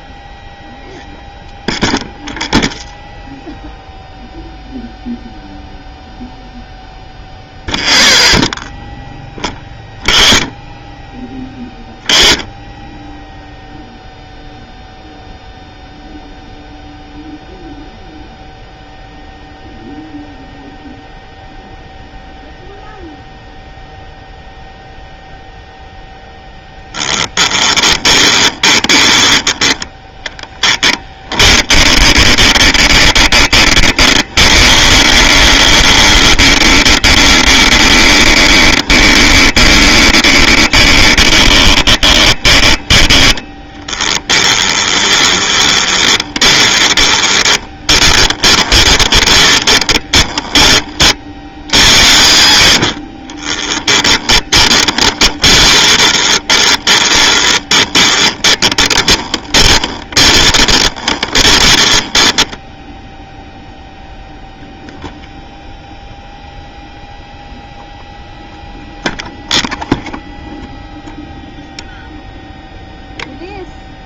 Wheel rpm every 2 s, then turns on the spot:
0, 0, 0, 0, 0, 0, 0, 0, 0, 0, 0, 0, 0, 10, 30, 10, 10, 20, 20, 20, 20, 20, 20, 20, 20, 40, 70, 20, 20, 10, 40, 0, 0, 0, 0, 0, 0.
26-42 44-50 54-62